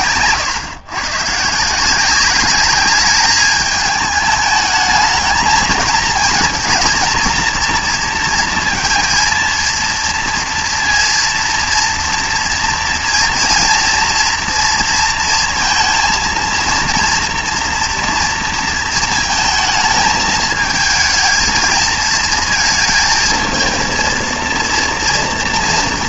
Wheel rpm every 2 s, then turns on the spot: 130, 200, 210, 230, 230, 230, 230, 230, 230, 230, 220, 220, 230.
none